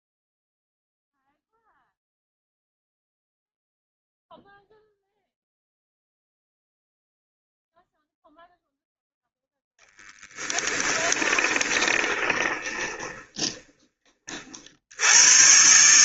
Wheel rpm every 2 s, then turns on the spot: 0, 0, 0, 0, 0, 10, 20, 70.
10-14